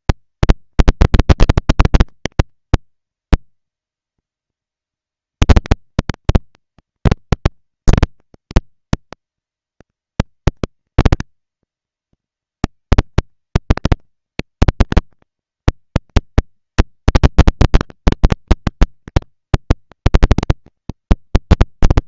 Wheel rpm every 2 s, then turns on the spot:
230, 240, 230, 230, 230, 230, 230, 220, 220, 200, 190.
none